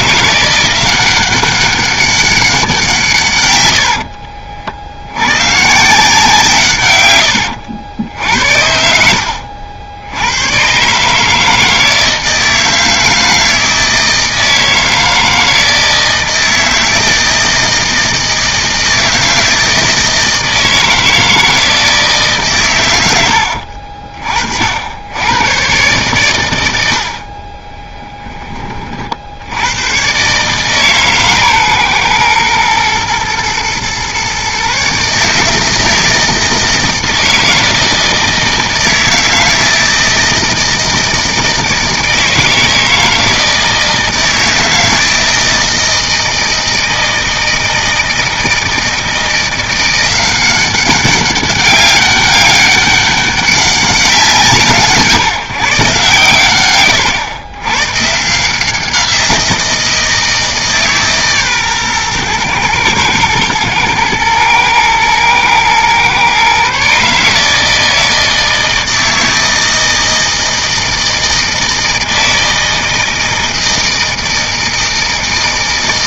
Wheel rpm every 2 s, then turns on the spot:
180, 180, 50, 140, 70, 120, 160, 160, 160, 160, 160, 130, 50, 100, 20, 140, 120, 140, 160, 160, 160, 160, 160, 160, 160, 190, 200, 160, 120, 170, 160, 120, 120, 130, 160, 160, 160, 160.
none